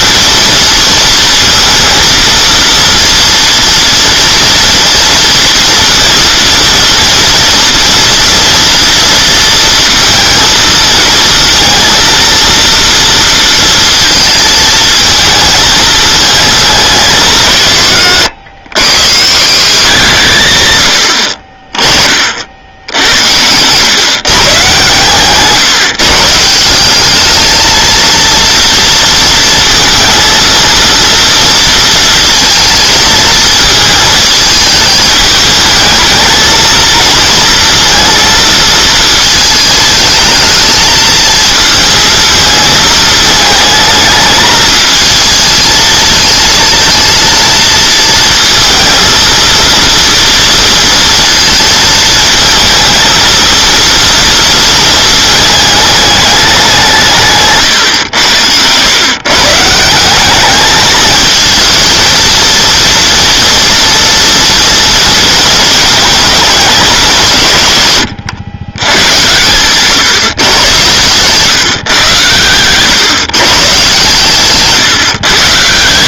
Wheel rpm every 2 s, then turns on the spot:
230, 240, 230, 230, 230, 220, 230, 220, 190, 110, 90, 70, 130, 190, 230, 230, 220, 220, 220, 220, 220, 220, 220, 230, 230, 230, 220, 230, 180, 110, 220, 240, 230, 200, 110, 110, 120, 140.
74-76